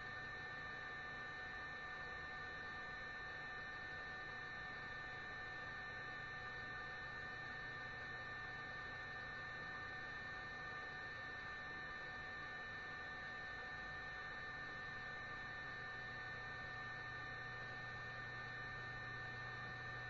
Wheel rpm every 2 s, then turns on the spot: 0, 0, 0, 0, 0, 0, 0, 0, 0, 0.
none